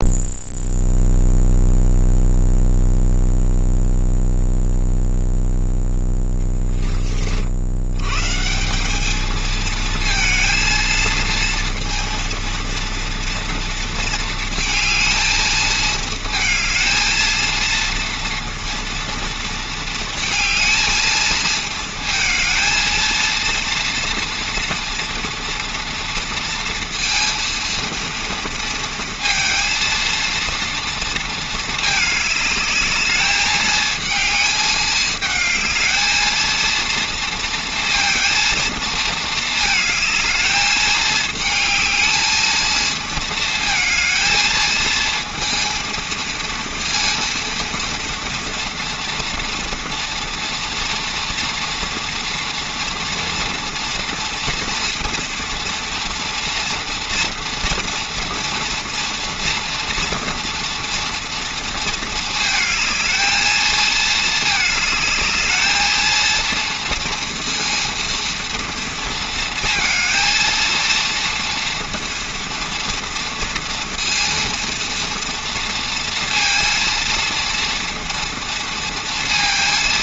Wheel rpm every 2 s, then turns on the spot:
0, 0, 0, 10, 190, 230, 230, 220, 220, 230, 220, 220, 230, 230, 230, 230, 220, 220, 230, 230, 220, 220, 220, 230, 230, 230, 230, 240, 240, 230, 230, 220, 220, 230, 230, 230, 230, 230, 230, 230.
none